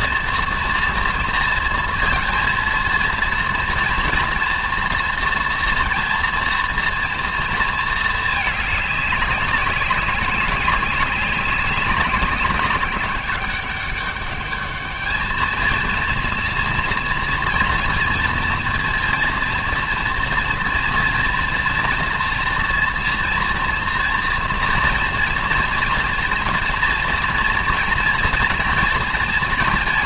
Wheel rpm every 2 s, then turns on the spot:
240, 230, 230, 240, 210, 190, 190, 210, 240, 230, 230, 230, 230, 230, 230.
none